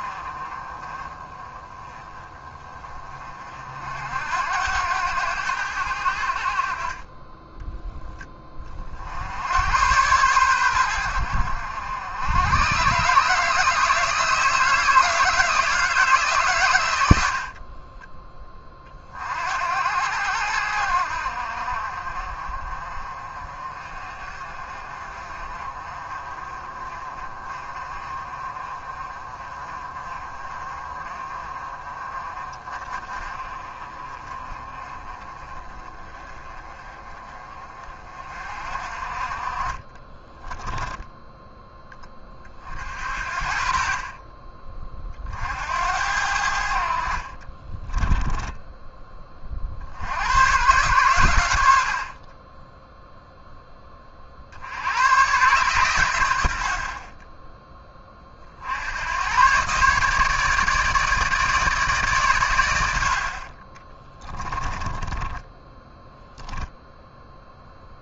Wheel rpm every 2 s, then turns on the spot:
30, 30, 90, 30, 50, 90, 130, 160, 90, 40, 70, 40, 40, 30, 30, 30, 30, 30, 30, 40, 10, 50, 40, 60, 10, 120, 0, 90, 50, 90, 150, 70, 20, 0.
64-66